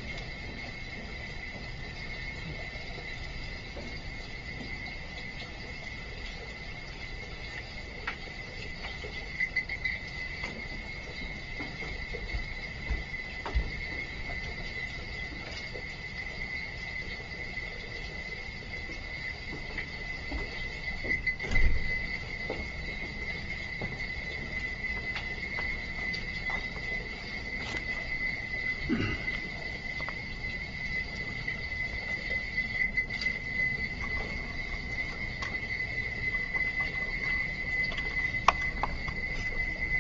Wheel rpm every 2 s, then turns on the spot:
0, 0, 0, 0, 0, 0, 0, 0, 0, 0, 0, 0, 0, 0, 0, 0, 0, 0, 0, 0.
none